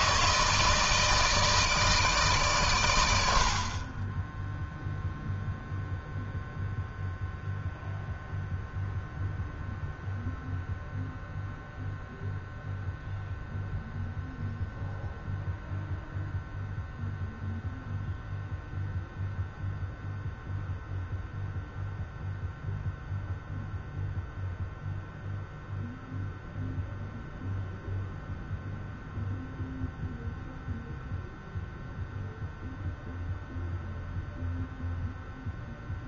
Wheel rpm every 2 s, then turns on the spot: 160, 130, 0, 0, 0, 0, 0, 0, 0, 0, 0, 0, 0, 0, 0, 0, 0, 0.
none